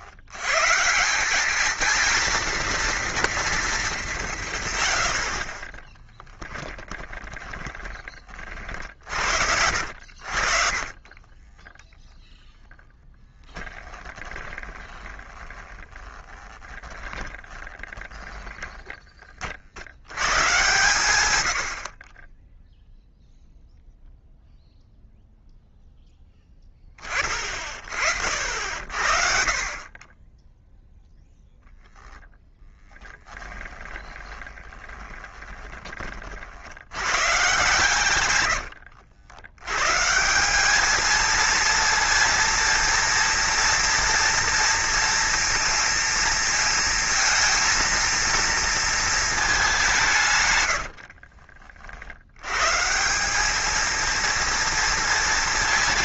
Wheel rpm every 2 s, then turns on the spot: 140, 230, 130, 10, 60, 50, 0, 20, 30, 10, 110, 0, 0, 10, 60, 0, 10, 20, 70, 90, 200, 230, 230, 230, 230, 110, 140, 230.
6-12 14-20 32-36 38-40 50-52